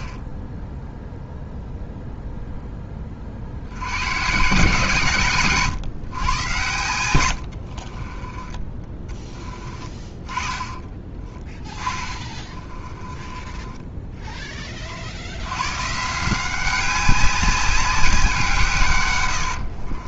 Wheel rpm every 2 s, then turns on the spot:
0, 10, 150, 100, 20, 30, 20, 30, 180, 160.
8-14